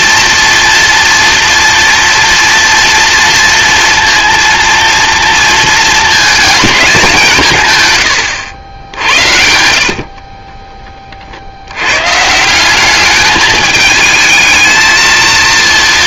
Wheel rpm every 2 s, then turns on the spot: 240, 230, 230, 210, 90, 20, 180, 220.
10-12